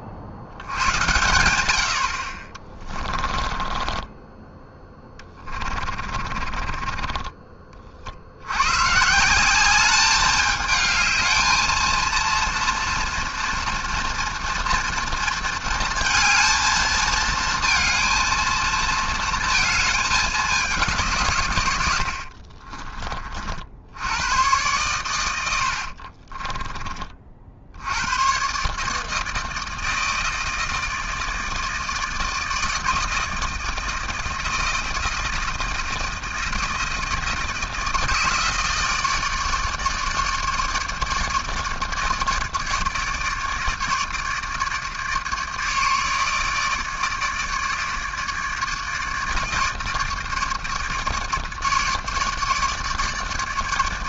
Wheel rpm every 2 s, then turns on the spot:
90, 40, 10, 30, 110, 210, 230, 230, 220, 220, 190, 30, 110, 20, 140, 160, 160, 160, 160, 160, 150, 150, 150, 150, 150, 150, 150.
2-4 6-8 22-24